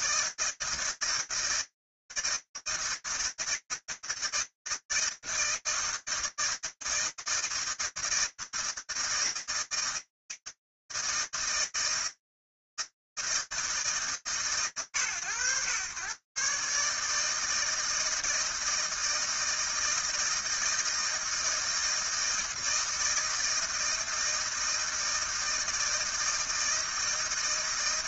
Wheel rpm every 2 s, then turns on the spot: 160, 160, 160, 160, 160, 160, 160, 130, 140, 160, 160, 160, 160, 160.
none